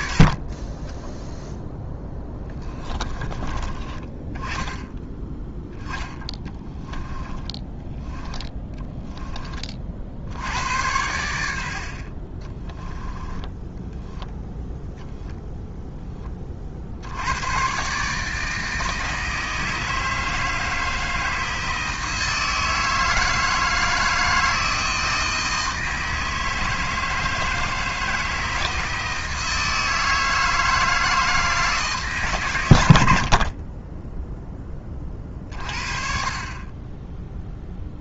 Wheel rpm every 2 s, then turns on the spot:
10, 20, 10, 10, 10, 90, 10, 0, 60, 160, 160, 160, 160, 160, 160, 160, 90, 20, 20.
0-2 6-10 12-14